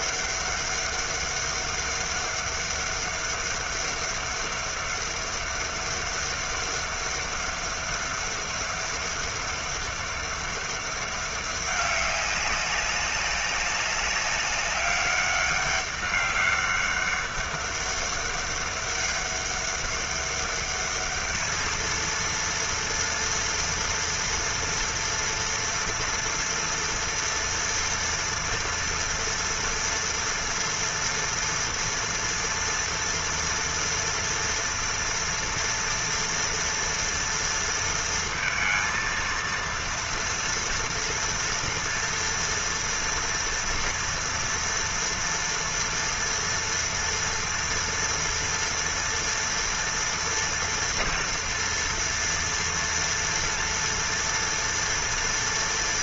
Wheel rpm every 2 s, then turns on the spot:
200, 200, 200, 200, 200, 200, 190, 200, 200, 200, 200, 230, 230, 230, 230, 230, 230, 230, 230, 230, 230, 230, 230, 230, 230, 230, 240, 230.
none